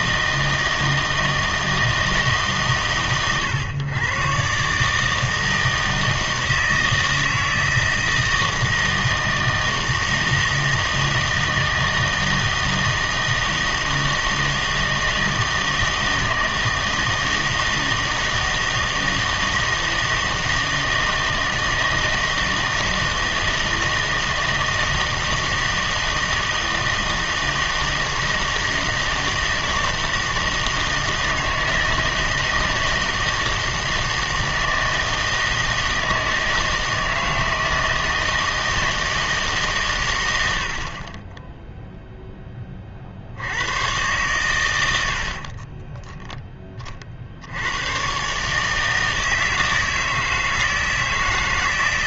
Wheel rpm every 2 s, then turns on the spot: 160, 130, 140, 160, 160, 160, 160, 160, 160, 160, 160, 160, 160, 160, 160, 160, 160, 160, 160, 160, 80, 10, 100, 10, 150, 160.
none